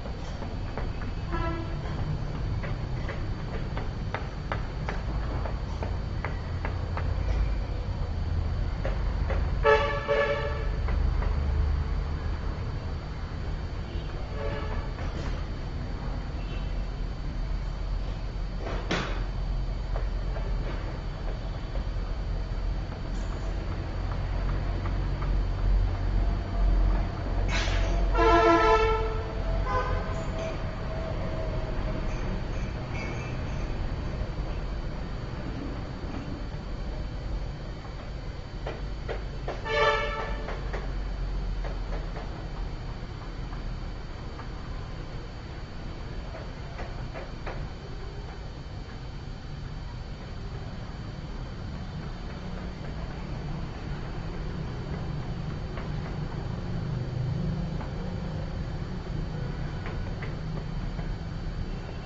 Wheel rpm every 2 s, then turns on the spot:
0, 0, 0, 0, 0, 0, 0, 0, 0, 0, 0, 0, 0, 0, 0, 0, 0, 0, 0, 0, 0, 0, 0, 0, 0, 0, 0, 0, 0, 0, 0.
none